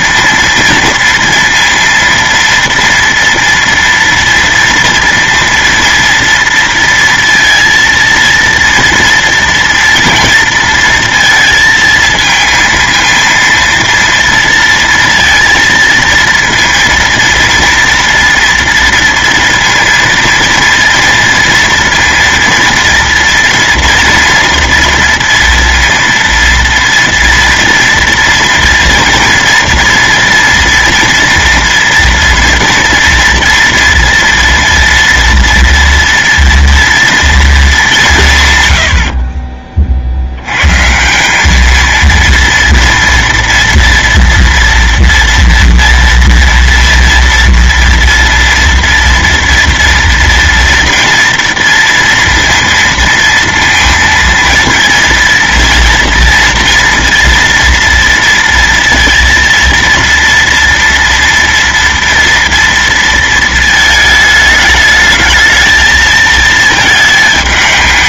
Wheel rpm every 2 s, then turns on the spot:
230, 230, 240, 230, 230, 230, 230, 230, 230, 230, 230, 230, 230, 230, 230, 230, 230, 230, 230, 130, 120, 230, 230, 230, 230, 230, 230, 230, 230, 230, 230, 230, 210, 220.
none